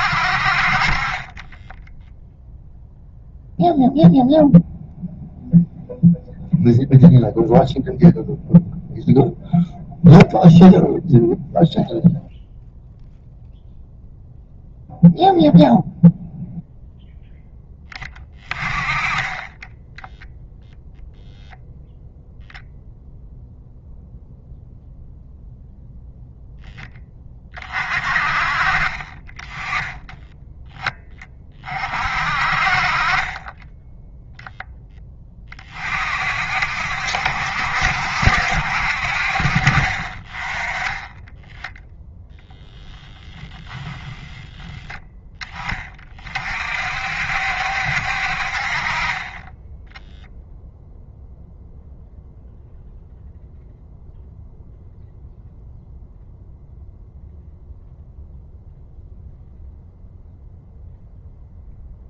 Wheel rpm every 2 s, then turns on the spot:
30, 0, 0, 0, 0, 0, 0, 0, 0, 20, 0, 0, 0, 0, 30, 10, 40, 0, 60, 60, 20, 0, 10, 50, 40, 0, 0, 0, 0, 0, 0.
none